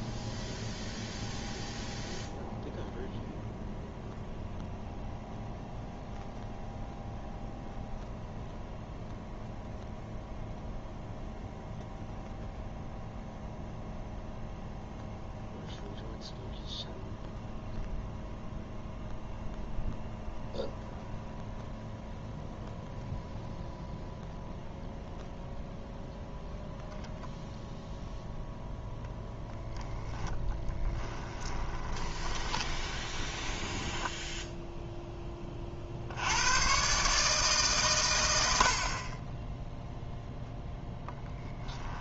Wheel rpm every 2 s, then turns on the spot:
0, 0, 0, 0, 0, 0, 0, 0, 0, 0, 0, 0, 0, 0, 0, 10, 20, 0, 90, 80, 0.
30-34